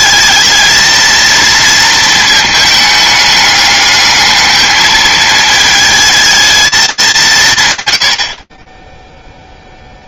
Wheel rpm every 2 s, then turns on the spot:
230, 210, 220, 210, 20.
none